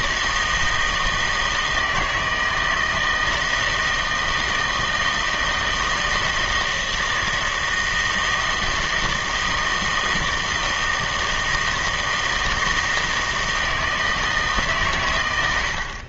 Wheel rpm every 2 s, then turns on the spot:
160, 160, 160, 160, 160, 160, 160, 140.
none